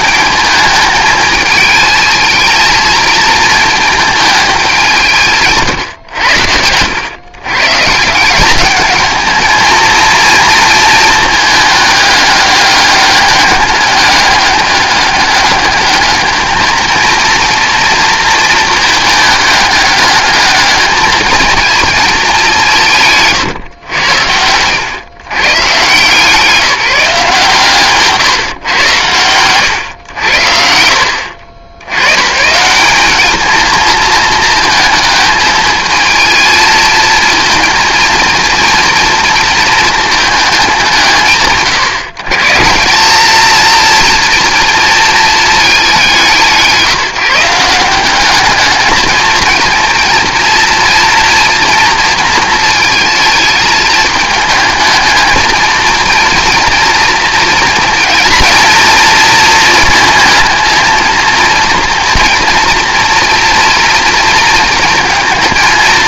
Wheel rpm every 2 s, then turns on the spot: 220, 220, 190, 100, 210, 230, 200, 200, 220, 220, 210, 190, 110, 170, 120, 70, 180, 220, 230, 230, 190, 170, 230, 170, 210, 230, 220, 220, 230, 230, 230, 240, 230.
none